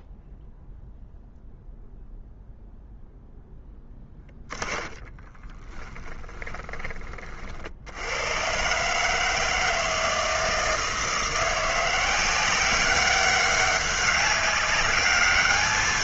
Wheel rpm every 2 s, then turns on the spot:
0, 0, 10, 20, 130, 160, 190, 200.
4-6